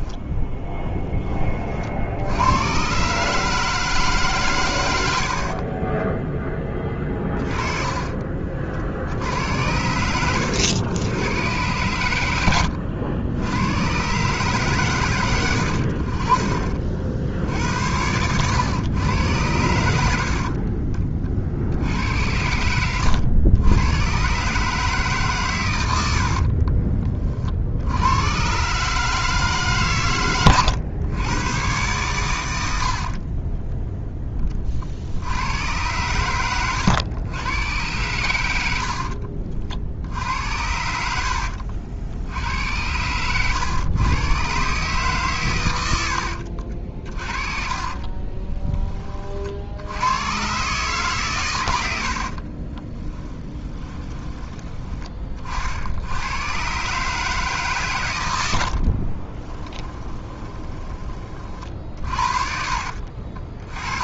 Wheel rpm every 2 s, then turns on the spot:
10, 130, 90, 20, 60, 100, 90, 120, 50, 110, 40, 100, 150, 30, 150, 110, 70, 60, 110, 70, 60, 100, 140, 40, 30, 140, 20, 20, 140, 60, 20, 50.
4-8 22-24 38-44 46-48 52-54 58-60 62-64